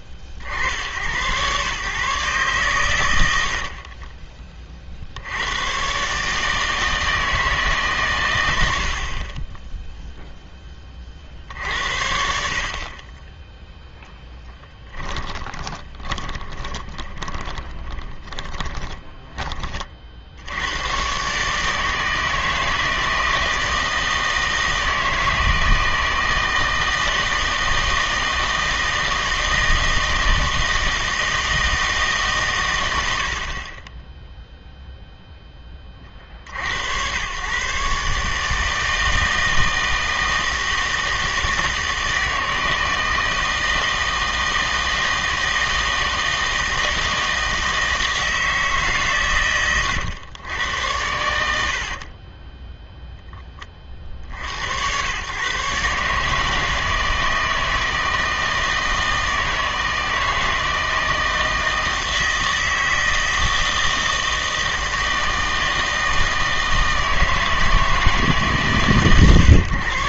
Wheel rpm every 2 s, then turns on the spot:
70, 120, 40, 160, 70, 10, 50, 10, 20, 10, 90, 160, 160, 160, 160, 160, 110, 0, 80, 150, 160, 160, 160, 160, 150, 100, 10, 80, 160, 160, 160, 160, 160, 160, 140.
14-20 32-34